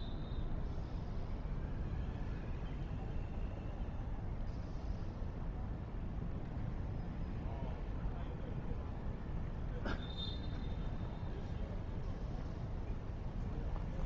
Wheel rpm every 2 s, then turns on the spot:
0, 0, 0, 0, 0, 0, 0.
none